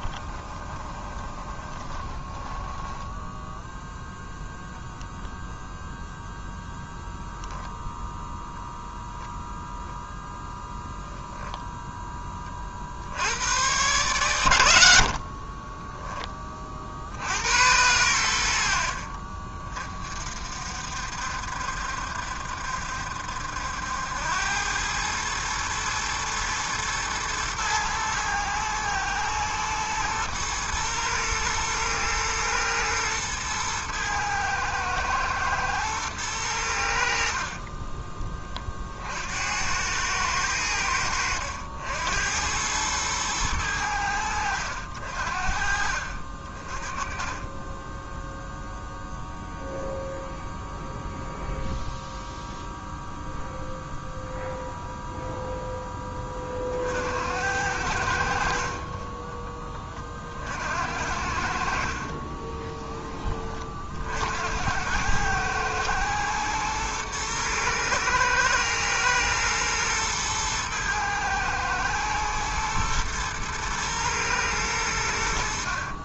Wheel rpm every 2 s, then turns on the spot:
20, 10, 0, 0, 0, 0, 50, 90, 30, 70, 60, 70, 100, 110, 110, 110, 110, 110, 80, 30, 90, 100, 80, 30, 0, 0, 0, 0, 50, 40, 60, 10, 100, 110, 110, 110, 120, 100.
0-4